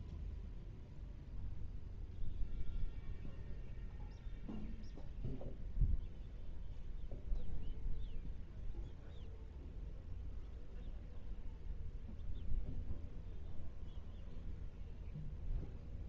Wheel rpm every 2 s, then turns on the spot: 0, 0, 0, 0, 0, 0, 0, 0.
none